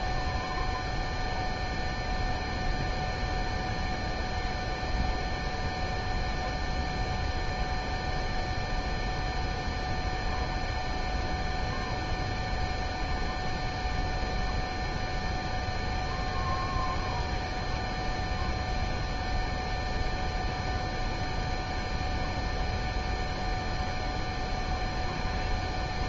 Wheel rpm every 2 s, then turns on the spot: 0, 0, 0, 0, 0, 0, 0, 0, 0, 0, 0, 0, 0.
none